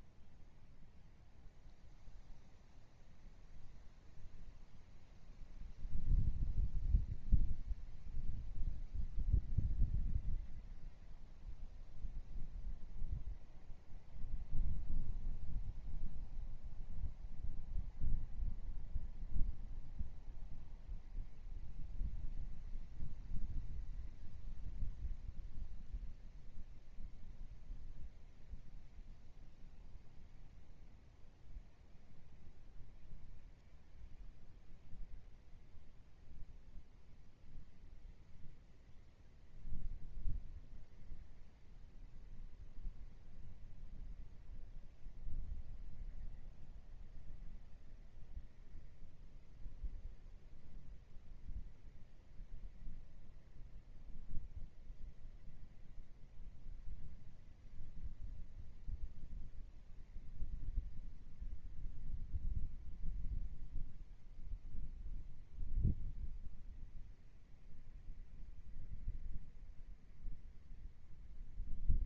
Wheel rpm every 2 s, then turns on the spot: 0, 0, 0, 0, 0, 0, 0, 0, 0, 0, 0, 0, 0, 0, 0, 0, 0, 0, 0, 0, 0, 0, 0, 0, 0, 0, 0, 0, 0, 0, 0, 0, 0, 0, 0, 0.
none